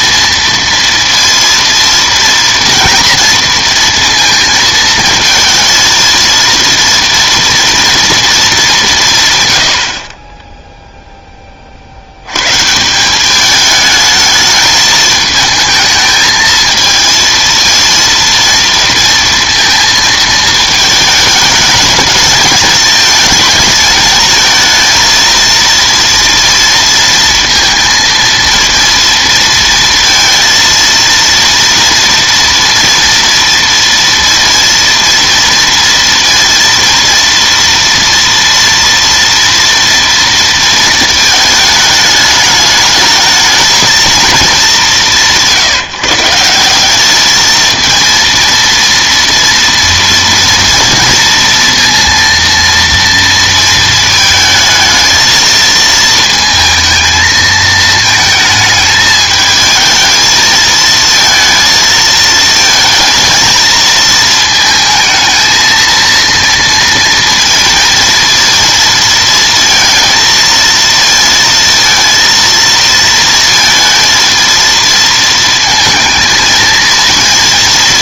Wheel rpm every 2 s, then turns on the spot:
230, 230, 230, 230, 220, 10, 120, 220, 220, 230, 220, 210, 220, 230, 230, 230, 240, 230, 230, 230, 230, 210, 210, 180, 230, 240, 230, 220, 230, 220, 220, 220, 220, 230, 230, 230, 230, 220, 220.
none